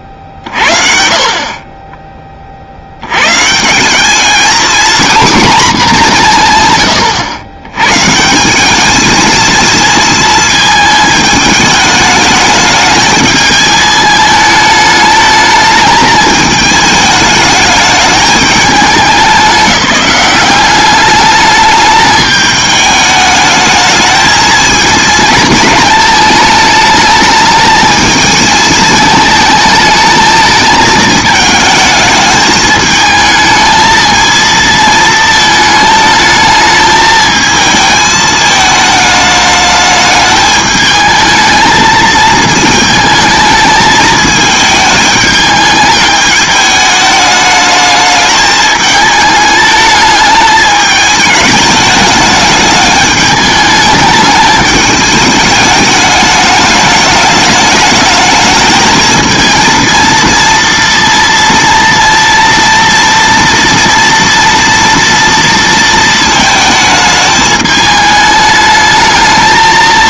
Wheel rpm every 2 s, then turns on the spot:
50, 80, 230, 130, 190, 220, 210, 210, 210, 210, 200, 210, 220, 220, 220, 220, 210, 220, 220, 220, 210, 220, 220, 210, 220, 210, 210, 210, 210, 220, 230, 230, 230, 220, 220.
none